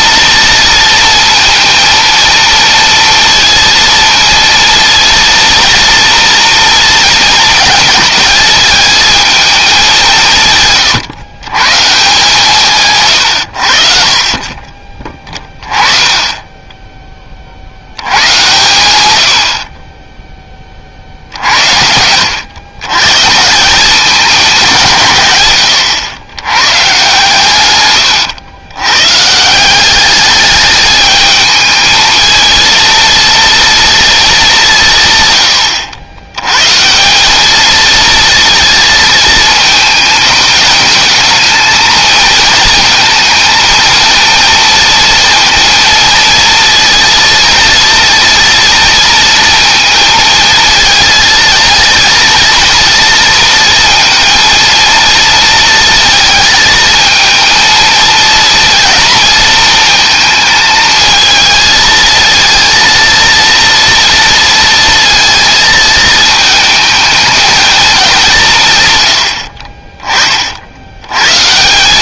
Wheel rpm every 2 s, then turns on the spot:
230, 230, 230, 230, 220, 130, 140, 20, 20, 100, 60, 130, 160, 120, 120, 210, 230, 140, 170, 220, 220, 220, 230, 230, 230, 220, 230, 230, 230, 230, 220, 230, 230, 220, 120, 90.
none